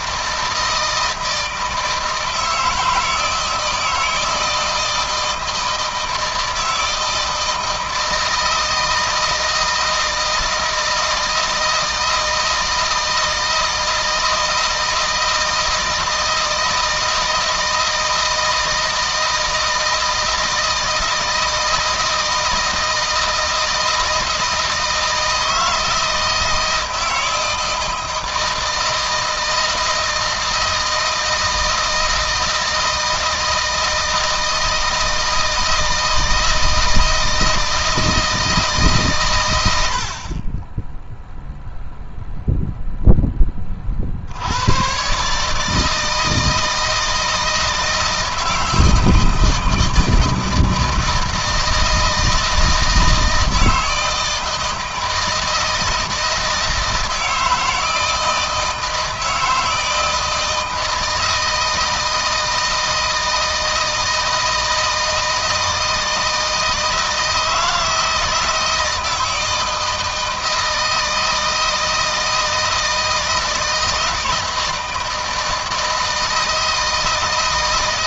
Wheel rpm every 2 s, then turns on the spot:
160, 160, 160, 160, 160, 160, 160, 160, 160, 160, 160, 160, 160, 160, 160, 160, 160, 160, 160, 150, 20, 0, 100, 160, 160, 160, 160, 160, 160, 160, 160, 160, 160, 160, 160, 160, 160, 160, 160.
none